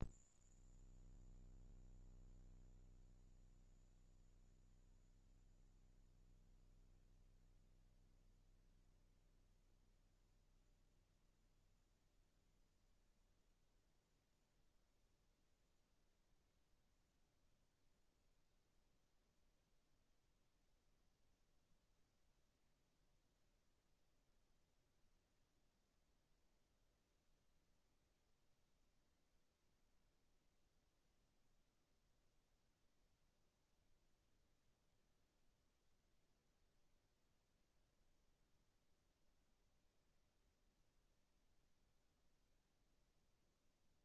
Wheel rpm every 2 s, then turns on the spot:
0, 0, 0, 0, 0, 0, 0, 0, 0, 0, 0, 0, 0, 0, 0, 0, 0, 0, 0, 0, 0, 0.
none